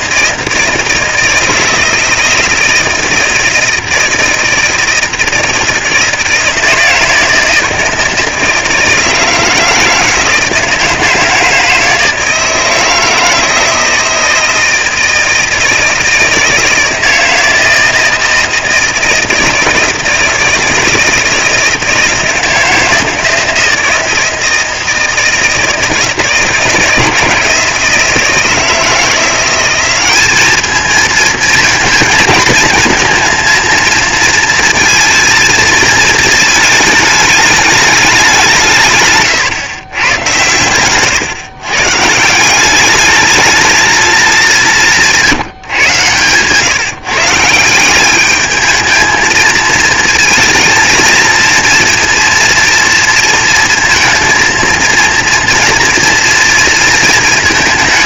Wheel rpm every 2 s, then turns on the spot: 160, 160, 160, 160, 160, 160, 160, 170, 160, 160, 160, 170, 160, 160, 160, 210, 220, 230, 220, 170, 110, 180, 190, 130, 210, 220, 230, 230, 240.
none